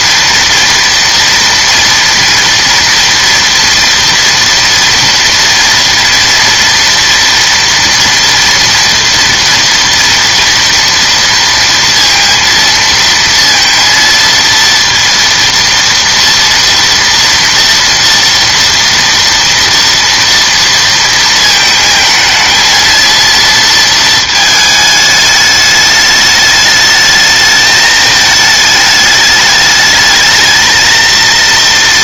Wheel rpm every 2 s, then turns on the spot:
230, 230, 230, 230, 230, 230, 230, 230, 230, 230, 230, 220, 220, 210, 210, 230.
none